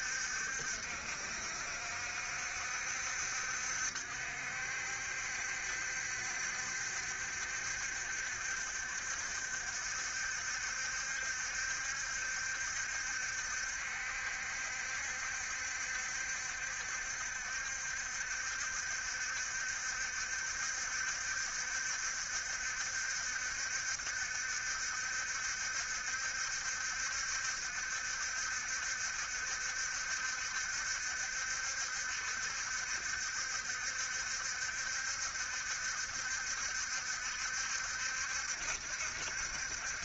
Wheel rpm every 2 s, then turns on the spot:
70, 70, 60, 70, 70, 70, 70, 70, 70, 70, 70, 70, 70, 70, 70, 70, 60, 70, 70, 70.
none